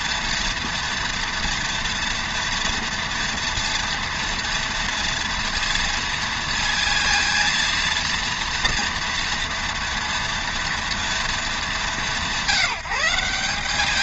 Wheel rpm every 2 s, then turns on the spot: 230, 230, 230, 230, 230, 230, 190.
none